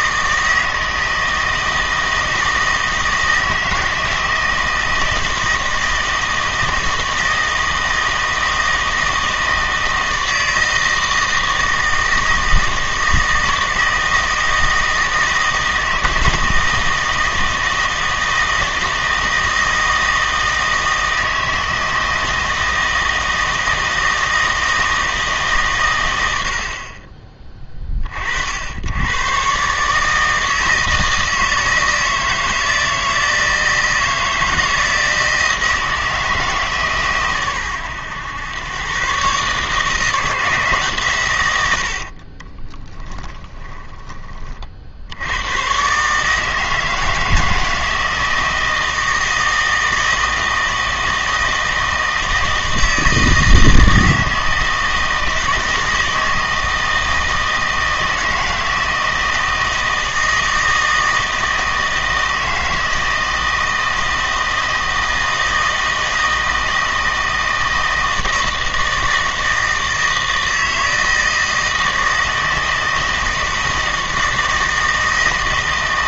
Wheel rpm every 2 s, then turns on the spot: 160, 160, 160, 160, 160, 160, 160, 160, 160, 160, 160, 160, 160, 60, 80, 160, 160, 160, 150, 120, 150, 20, 50, 160, 160, 160, 160, 160, 160, 160, 160, 160, 160, 160, 160, 160, 160, 160.
42-44